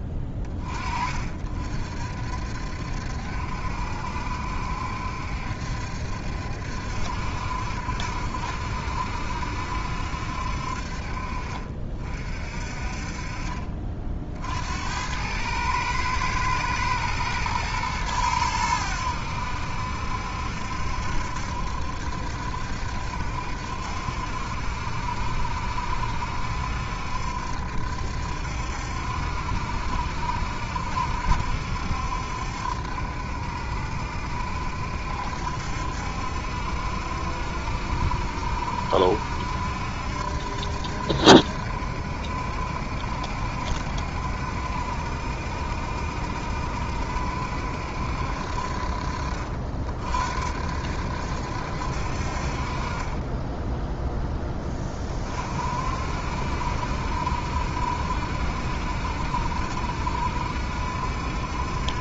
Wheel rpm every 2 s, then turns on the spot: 30, 60, 70, 70, 70, 60, 40, 70, 110, 90, 70, 70, 70, 70, 70, 70, 70, 70, 70, 70, 70, 70, 70, 70, 50, 60, 40, 20, 60, 70, 70.
none